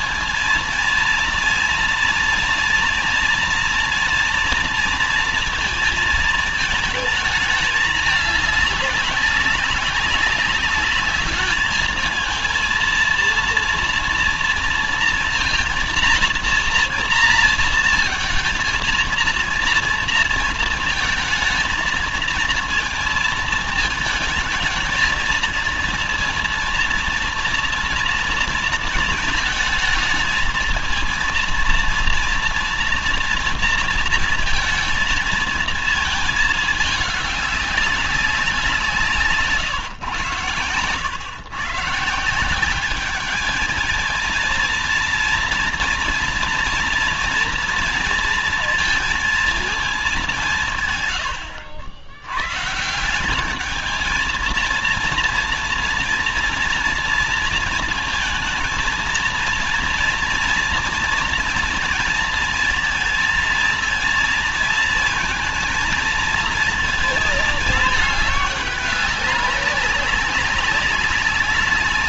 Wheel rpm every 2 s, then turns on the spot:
230, 230, 230, 220, 210, 200, 230, 230, 230, 230, 230, 220, 220, 230, 230, 220, 230, 230, 220, 180, 110, 180, 220, 230, 230, 170, 130, 230, 240, 230, 240, 230, 230, 230, 210, 200.
none